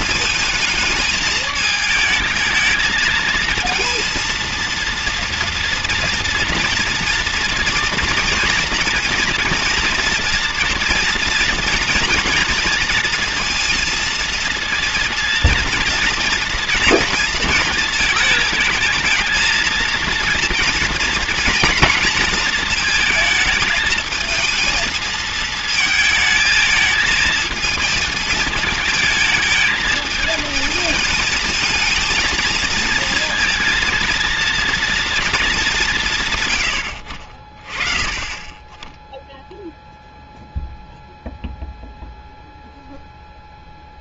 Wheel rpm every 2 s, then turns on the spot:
220, 220, 230, 230, 230, 230, 230, 230, 230, 220, 230, 230, 220, 220, 220, 220, 220, 230, 110, 10, 0, 0.
none